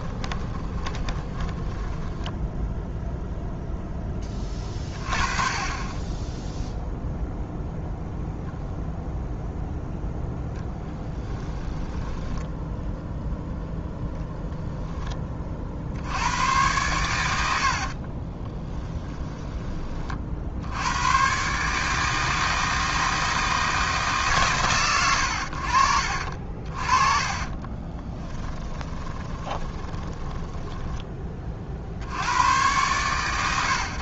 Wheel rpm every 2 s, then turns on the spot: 20, 0, 30, 0, 0, 10, 0, 10, 110, 10, 100, 160, 110, 40, 20, 10, 110.
0-2 10-12 18-20 26-30